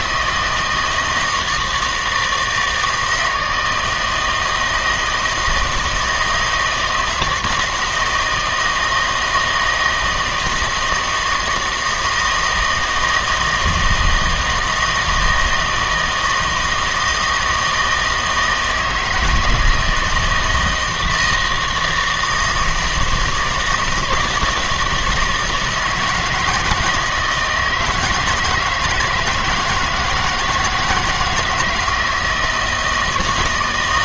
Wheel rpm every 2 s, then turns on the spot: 160, 160, 160, 160, 160, 160, 160, 160, 160, 160, 160, 160, 160, 160, 160, 160, 160.
none